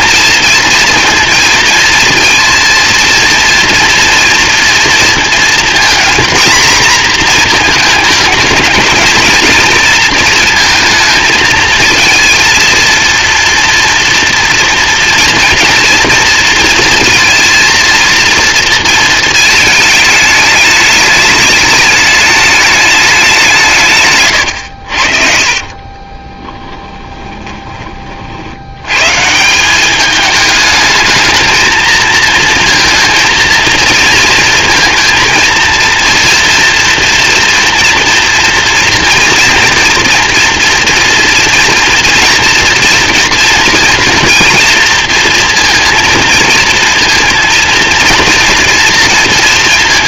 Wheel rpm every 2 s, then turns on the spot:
230, 230, 230, 240, 220, 230, 230, 240, 230, 230, 210, 210, 90, 10, 100, 210, 230, 230, 240, 230, 240, 230, 230, 220, 230.
26-28